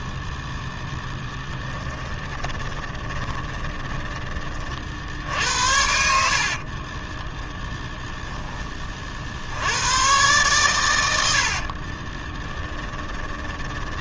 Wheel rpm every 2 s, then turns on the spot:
0, 20, 40, 30, 20, 120, 20.
2-4 6-8 12-14